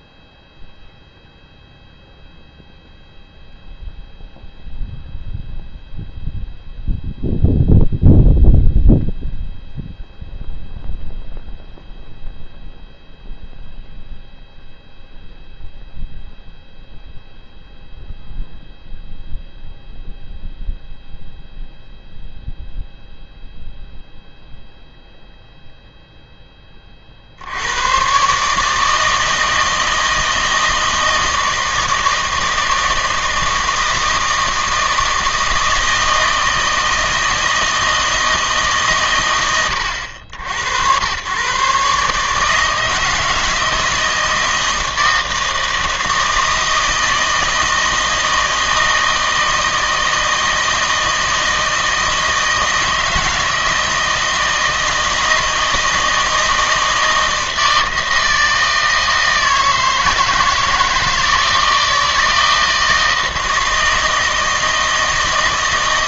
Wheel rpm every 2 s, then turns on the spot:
0, 0, 0, 0, 0, 0, 0, 0, 0, 0, 0, 0, 0, 20, 150, 160, 160, 160, 160, 150, 90, 160, 160, 160, 160, 160, 160, 160, 160, 160, 160, 160, 160.
none